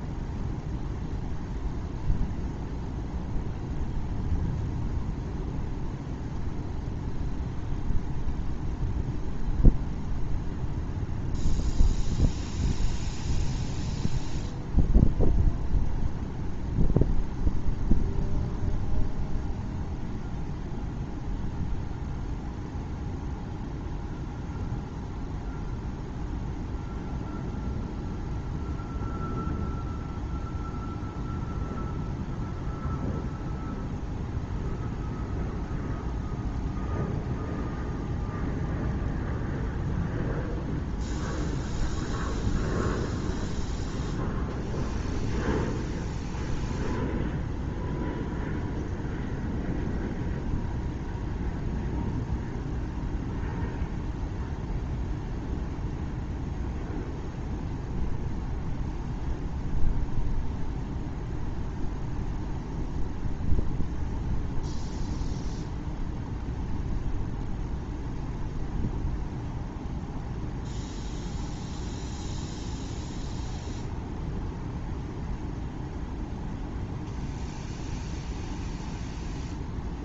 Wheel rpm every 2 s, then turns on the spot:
0, 0, 0, 0, 0, 0, 0, 0, 0, 0, 0, 0, 0, 0, 0, 0, 0, 0, 0, 0, 0, 0, 0, 0, 0, 0, 0, 0, 0, 0, 0, 0, 0, 0, 0, 0, 0, 0, 0, 0.
none